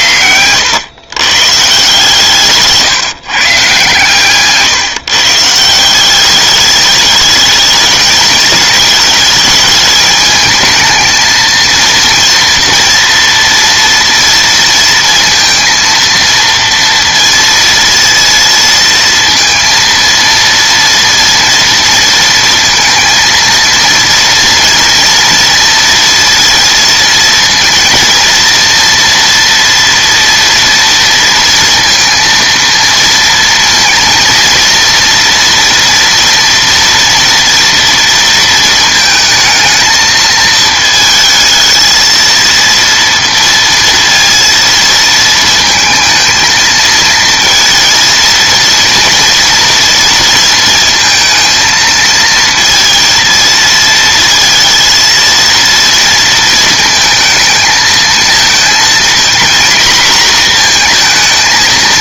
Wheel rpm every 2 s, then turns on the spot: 100, 150, 140, 210, 220, 220, 230, 230, 230, 230, 230, 230, 230, 230, 230, 230, 230, 230, 230, 230, 220, 230, 230, 220, 230, 230, 230, 230, 230, 230, 230.
none